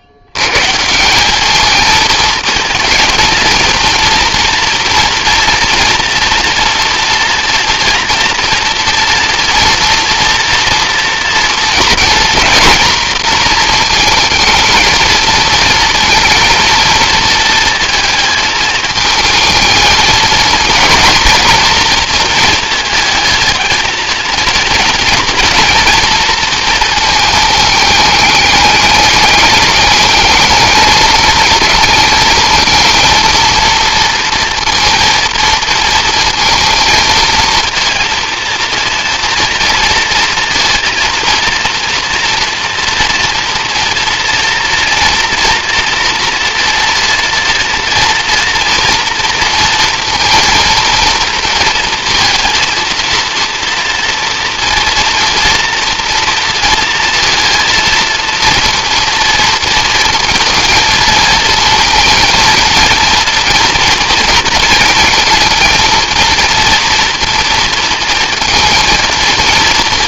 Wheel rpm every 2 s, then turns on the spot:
90, 220, 230, 230, 230, 230, 230, 230, 230, 220, 220, 230, 230, 230, 210, 220, 220, 230, 230, 230, 230, 230, 230, 230, 230, 230, 230, 230, 230, 230, 230, 230, 230, 230, 230.
none